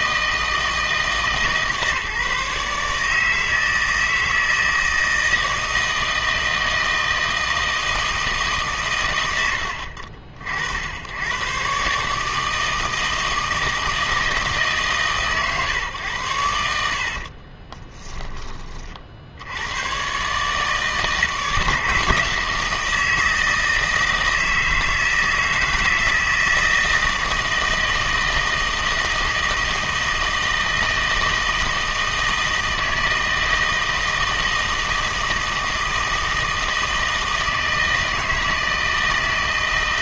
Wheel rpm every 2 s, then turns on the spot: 160, 150, 160, 160, 140, 70, 160, 150, 80, 30, 150, 160, 160, 160, 160, 160, 160, 160, 160, 160.
16-18